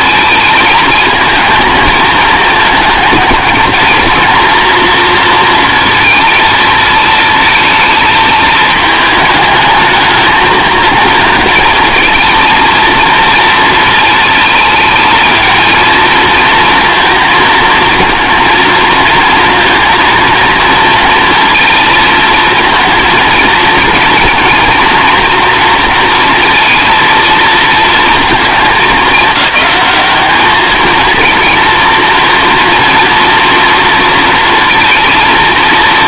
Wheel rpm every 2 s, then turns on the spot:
220, 220, 230, 220, 220, 230, 230, 220, 230, 230, 230, 220, 230, 230, 210, 220, 230, 230.
none